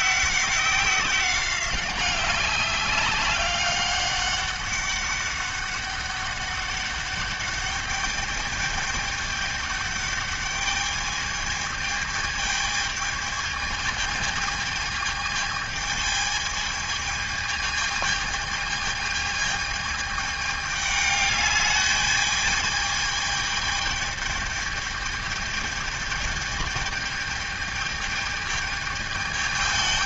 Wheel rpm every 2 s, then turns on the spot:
190, 190, 200, 200, 210, 210, 220, 220, 210, 210, 210, 210, 210, 210, 210.
none